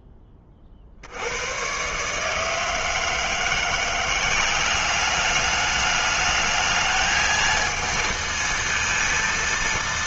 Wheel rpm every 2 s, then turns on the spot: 80, 160, 210, 220, 220.
none